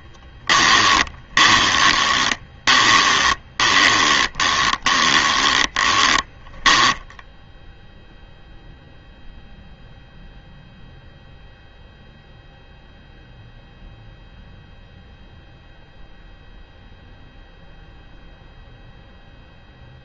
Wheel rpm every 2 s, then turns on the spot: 20, 20, 20, 10, 0, 0, 0, 0, 0, 0.
0-8